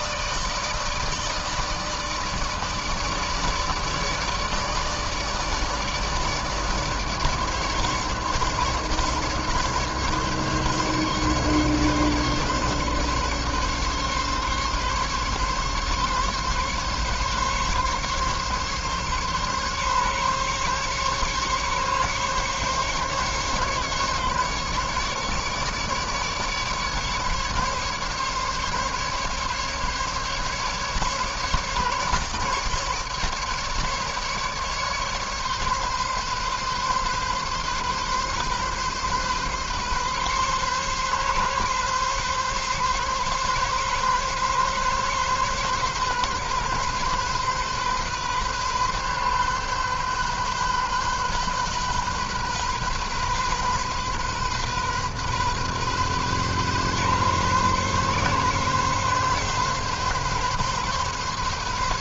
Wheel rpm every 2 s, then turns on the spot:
150, 150, 150, 150, 140, 140, 140, 140, 140, 140, 140, 140, 140, 150, 140, 140, 150, 140, 140, 130, 140, 140, 140, 140, 130, 130, 130, 130, 130, 130, 140.
none